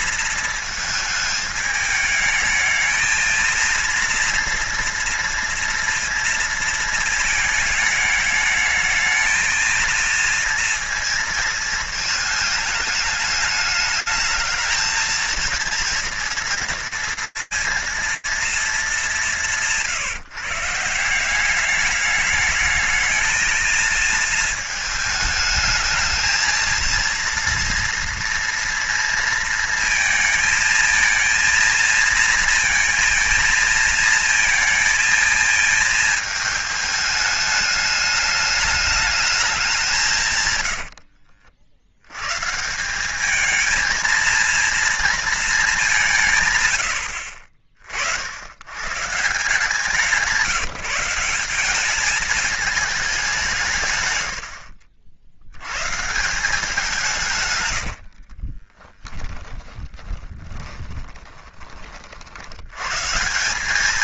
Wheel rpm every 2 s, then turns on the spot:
220, 220, 230, 230, 220, 230, 210, 220, 230, 220, 160, 210, 220, 220, 230, 220, 230, 220, 220, 210, 100, 150, 230, 110, 100, 170, 220, 70, 170, 30, 20, 90.
40-42 58-62